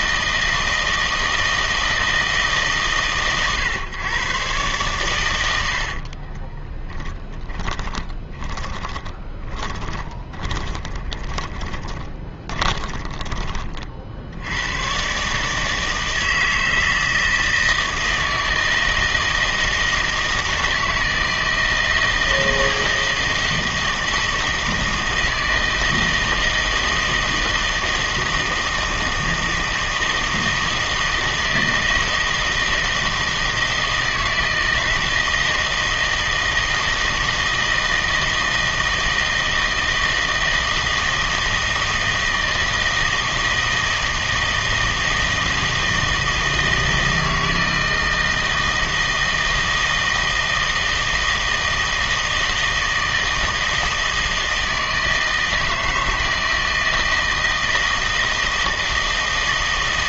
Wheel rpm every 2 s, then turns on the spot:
160, 150, 120, 20, 20, 20, 20, 100, 160, 160, 160, 160, 160, 160, 160, 160, 160, 160, 160, 160, 170, 160, 160, 160, 160, 160, 160, 160, 160, 160.
6-14